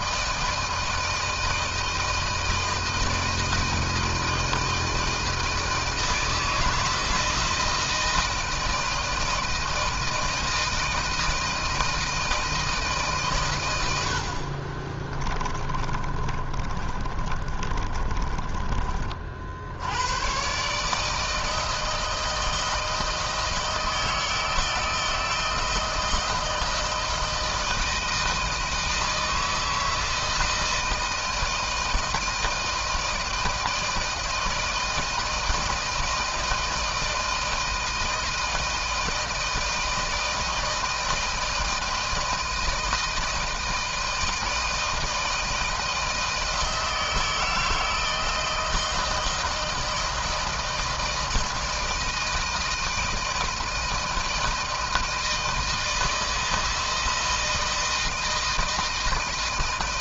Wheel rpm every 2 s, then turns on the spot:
160, 160, 160, 160, 160, 160, 160, 60, 30, 30, 110, 160, 160, 160, 160, 160, 160, 160, 160, 160, 160, 160, 160, 160, 160, 160, 160, 160, 160, 160.
14-20